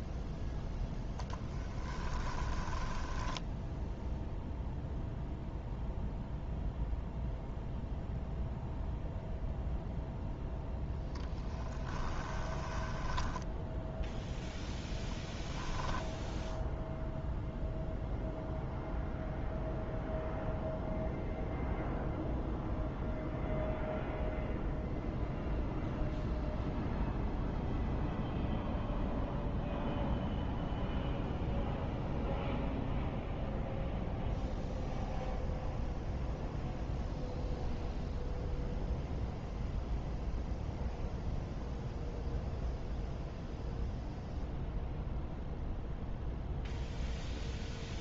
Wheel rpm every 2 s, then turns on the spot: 0, 20, 0, 0, 0, 0, 20, 0, 0, 0, 0, 0, 0, 0, 0, 0, 0, 0, 0, 0, 0, 0, 0, 0.
2-4 12-14